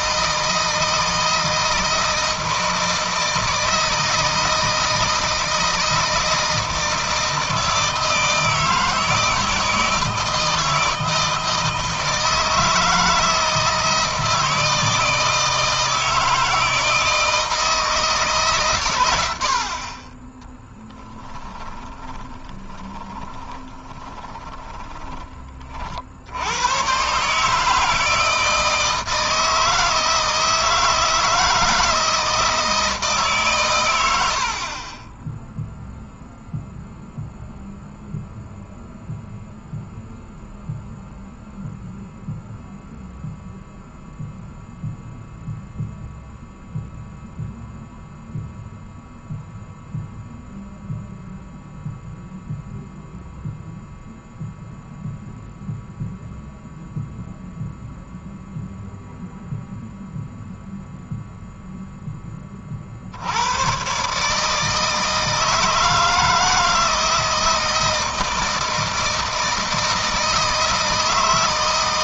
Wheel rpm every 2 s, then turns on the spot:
160, 160, 160, 160, 160, 160, 160, 160, 160, 120, 10, 30, 20, 110, 160, 160, 160, 30, 0, 0, 0, 0, 0, 0, 0, 0, 0, 0, 0, 0, 0, 40, 150, 160, 160, 160.
18-26